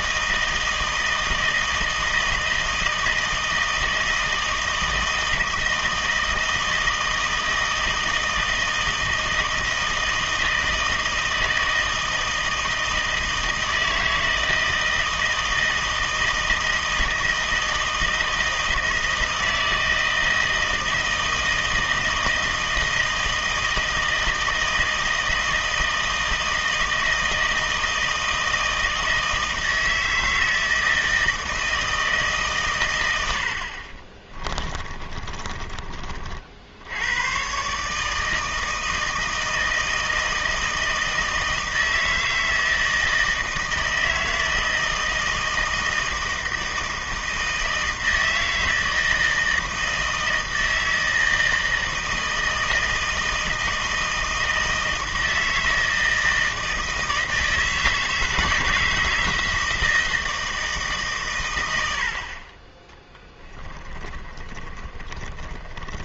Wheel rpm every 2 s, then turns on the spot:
160, 160, 160, 160, 160, 160, 160, 160, 160, 160, 160, 160, 160, 160, 160, 160, 130, 30, 70, 160, 160, 160, 160, 160, 160, 160, 160, 160, 160, 160, 160, 40, 20.
34-36 64-66